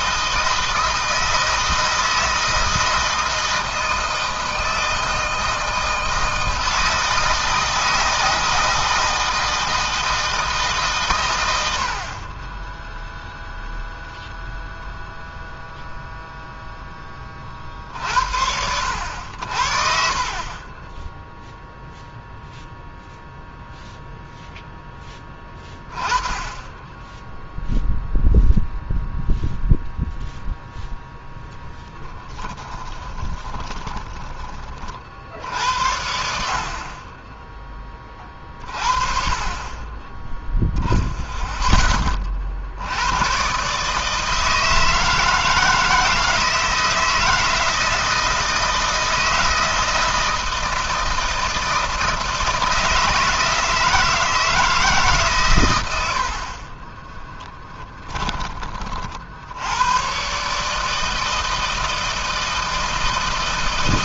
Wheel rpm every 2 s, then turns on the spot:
160, 160, 160, 160, 160, 140, 10, 0, 10, 70, 20, 0, 10, 10, 0, 0, 20, 40, 30, 30, 0, 80, 160, 170, 160, 160, 160, 150, 30, 40, 150, 160.
32-34 56-58